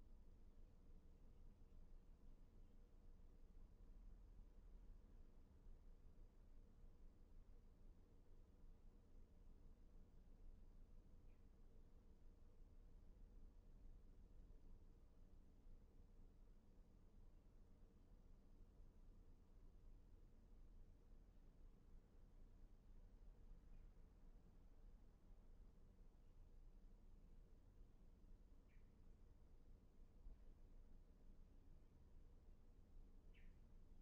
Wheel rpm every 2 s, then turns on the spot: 0, 0, 0, 0, 0, 0, 0, 0, 0, 0, 0, 0, 0, 0, 0, 0, 0.
none